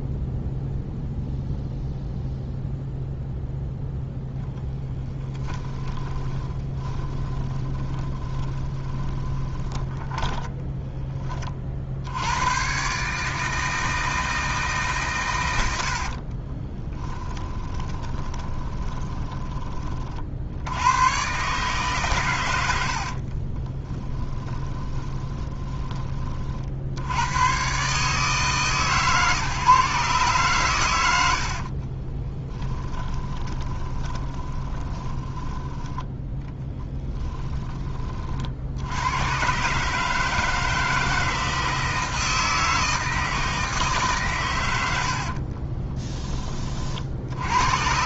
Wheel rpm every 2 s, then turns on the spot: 0, 0, 10, 20, 20, 10, 130, 150, 20, 20, 90, 90, 20, 60, 140, 110, 20, 20, 10, 80, 160, 160, 100, 40.
4-12 16-20 22-26 32-38